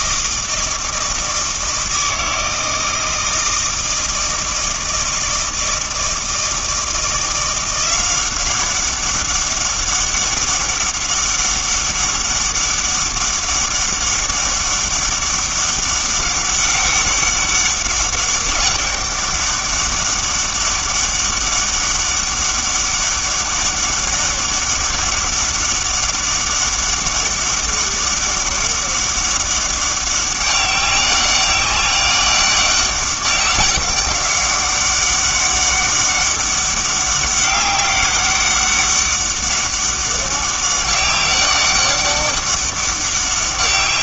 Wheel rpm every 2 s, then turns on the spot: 160, 160, 160, 170, 190, 200, 200, 200, 200, 200, 200, 200, 200, 200, 200, 200, 200, 200, 200, 200, 200, 200.
none